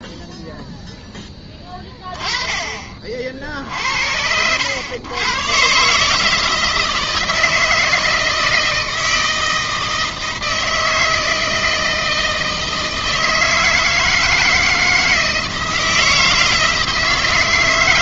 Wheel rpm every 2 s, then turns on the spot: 0, 30, 100, 160, 160, 160, 160, 160, 160.
none